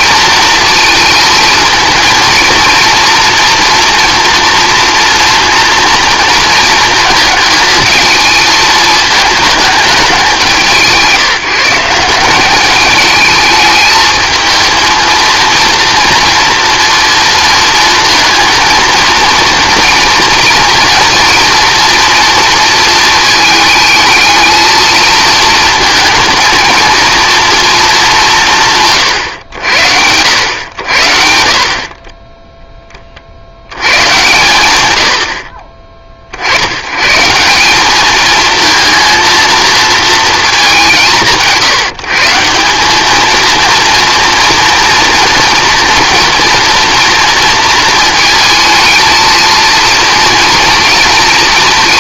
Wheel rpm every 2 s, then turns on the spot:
230, 230, 230, 230, 220, 190, 200, 220, 230, 230, 230, 230, 220, 220, 170, 90, 10, 110, 80, 220, 210, 180, 230, 240, 220, 230.
none